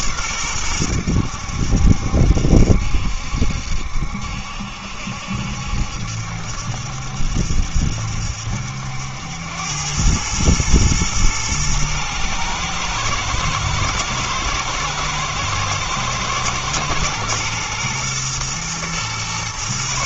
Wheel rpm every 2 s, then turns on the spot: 100, 70, 70, 70, 70, 110, 110, 120, 120, 120.
none